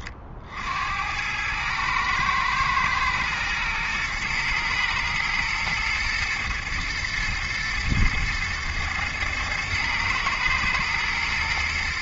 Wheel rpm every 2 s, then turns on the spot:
70, 120, 110, 120, 110, 110.
none